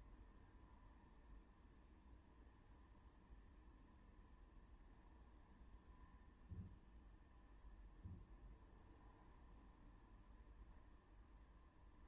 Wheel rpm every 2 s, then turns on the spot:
0, 0, 0, 0, 0, 0.
none